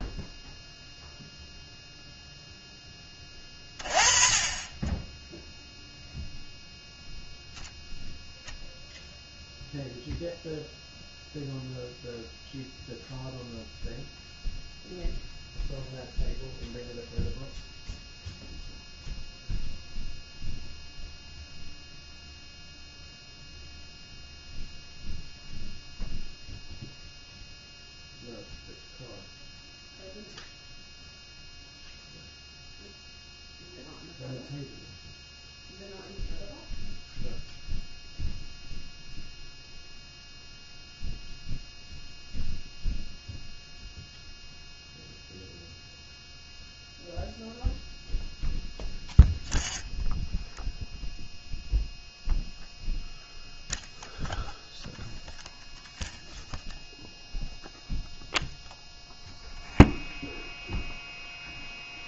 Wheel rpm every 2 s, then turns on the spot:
0, 0, 20, 0, 0, 0, 0, 0, 0, 0, 0, 0, 0, 0, 0, 0, 0, 0, 0, 0, 0, 0, 0, 0, 0, 0, 0, 0, 0, 0, 0.
none